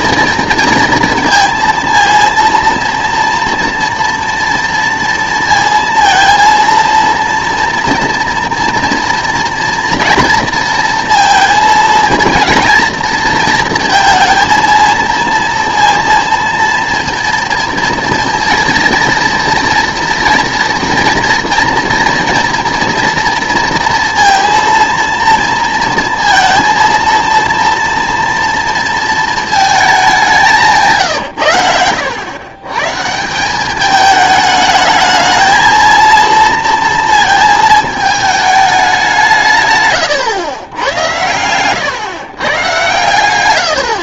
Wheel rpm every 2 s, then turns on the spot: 230, 230, 230, 230, 230, 230, 230, 230, 230, 230, 240, 230, 230, 230, 230, 170, 120, 220, 230, 200, 100, 120.
none